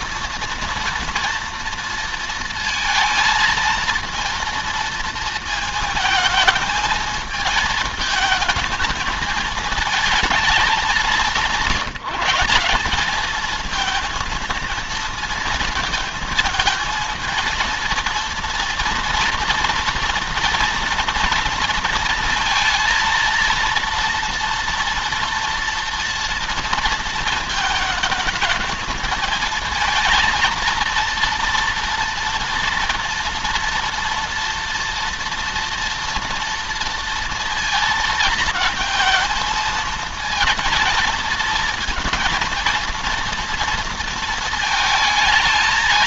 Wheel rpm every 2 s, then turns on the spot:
230, 230, 230, 220, 220, 210, 180, 230, 220, 230, 230, 230, 230, 230, 220, 230, 230, 230, 230, 220, 230, 230, 220.
none